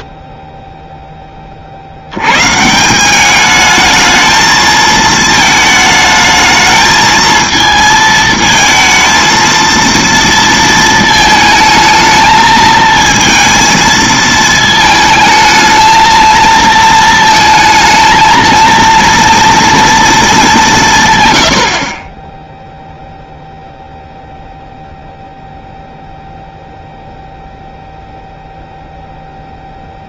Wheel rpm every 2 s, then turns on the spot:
0, 60, 210, 220, 220, 230, 220, 220, 220, 220, 230, 10, 0, 0, 0.
none